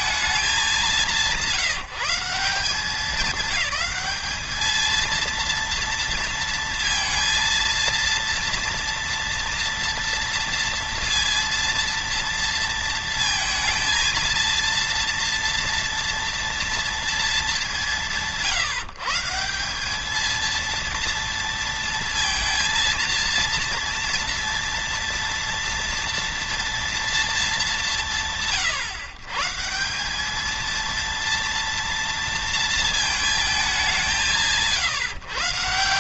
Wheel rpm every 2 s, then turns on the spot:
200, 180, 220, 230, 230, 230, 230, 230, 230, 160, 230, 230, 230, 230, 140, 230, 230, 130.
none